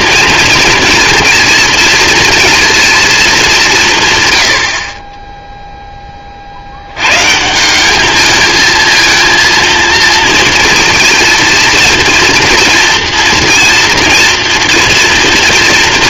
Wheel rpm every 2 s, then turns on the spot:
230, 230, 70, 70, 220, 230, 230, 230.
none